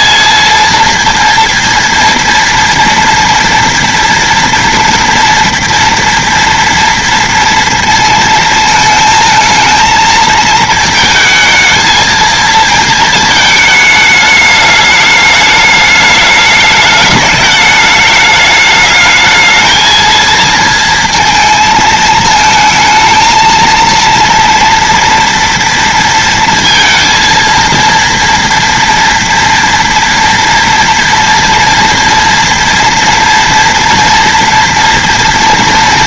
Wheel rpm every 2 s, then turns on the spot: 230, 230, 230, 230, 220, 220, 220, 210, 210, 220, 230, 220, 230, 230, 230, 230, 230, 230.
none